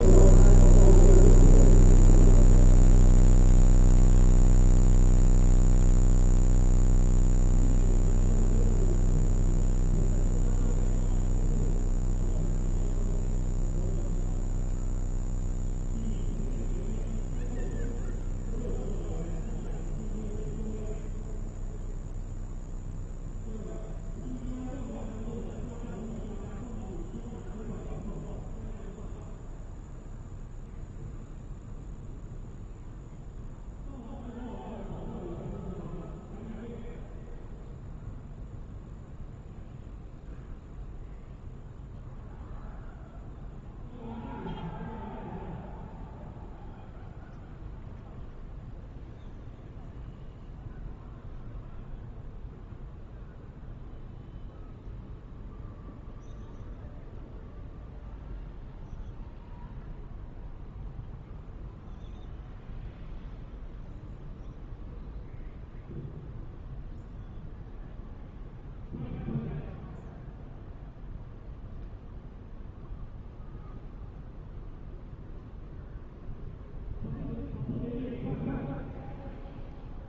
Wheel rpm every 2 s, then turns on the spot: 0, 0, 0, 0, 0, 0, 0, 0, 0, 0, 0, 0, 0, 0, 0, 0, 0, 0, 0, 0, 0, 0, 0, 0, 0, 0, 0, 0, 0, 0, 0, 0, 0, 0, 0, 0, 0, 0, 0, 0.
none